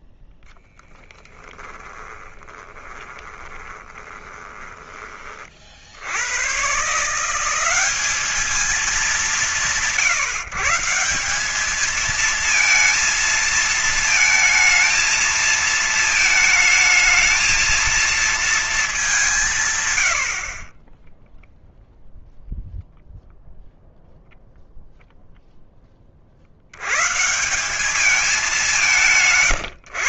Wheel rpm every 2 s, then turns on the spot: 0, 20, 20, 100, 200, 140, 220, 230, 220, 220, 80, 0, 0, 60, 190.
2-6